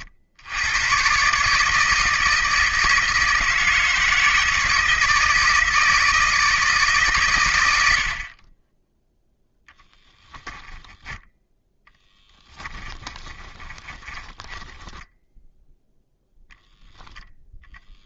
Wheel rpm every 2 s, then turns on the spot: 110, 160, 160, 140, 10, 10, 20, 10, 0.
10-14